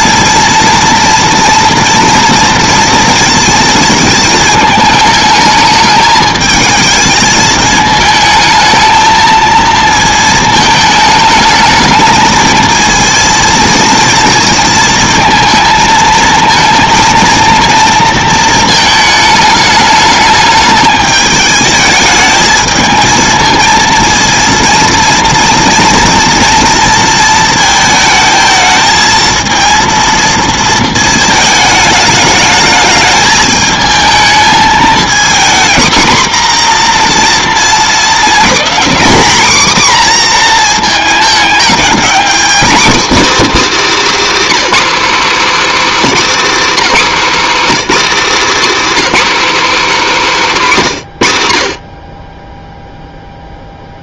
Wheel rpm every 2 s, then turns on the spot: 230, 230, 220, 220, 220, 220, 220, 230, 220, 220, 210, 220, 230, 230, 220, 230, 210, 220, 250, 250, 230, 270, 300, 280, 290, 220, 10.
none